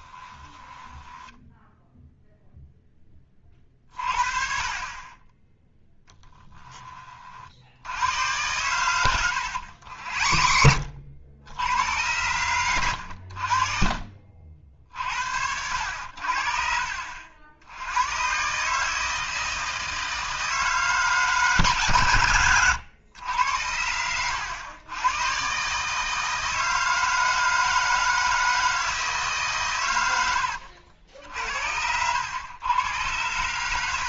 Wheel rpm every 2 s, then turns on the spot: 10, 0, 40, 20, 110, 60, 100, 50, 60, 140, 160, 110, 100, 160, 160, 70, 110.
0-2 6-8 22-24